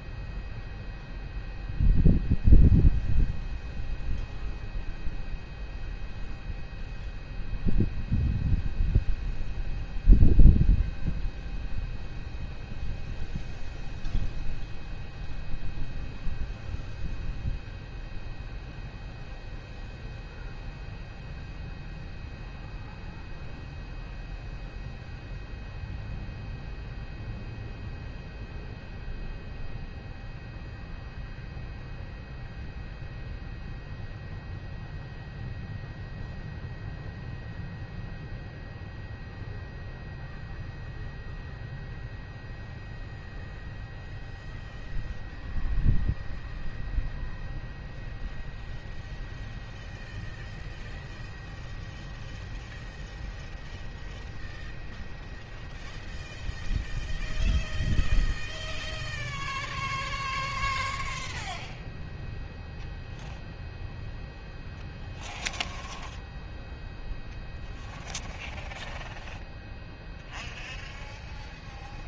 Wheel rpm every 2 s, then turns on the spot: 0, 0, 0, 0, 0, 0, 0, 0, 0, 0, 0, 0, 0, 0, 0, 0, 0, 0, 0, 0, 0, 0, 0, 0, 0, 0, 0, 0, 0, 0, 0, 0, 0, 0, 0, 0.
none